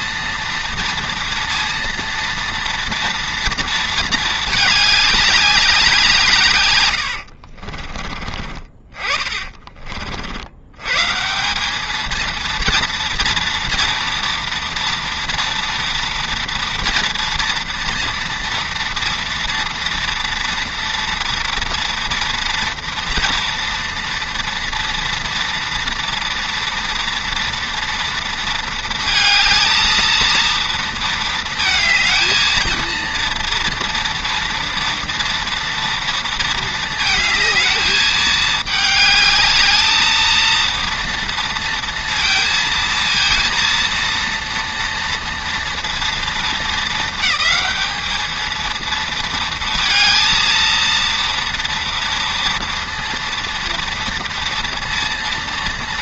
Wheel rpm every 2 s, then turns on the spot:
230, 230, 210, 130, 20, 90, 230, 230, 230, 230, 230, 230, 230, 230, 230, 230, 220, 230, 220, 210, 230, 230, 230, 220, 220, 230, 230, 230.
6-10